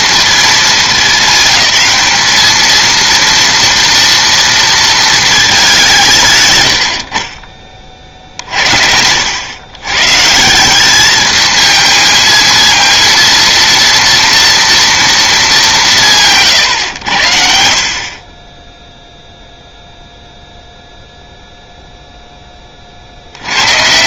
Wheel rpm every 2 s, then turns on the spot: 220, 210, 230, 110, 60, 170, 230, 240, 130, 20, 0, 20.
none